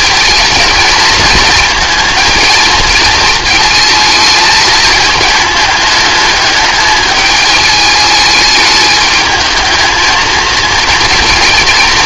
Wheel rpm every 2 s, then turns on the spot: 220, 220, 220, 210, 220, 230.
none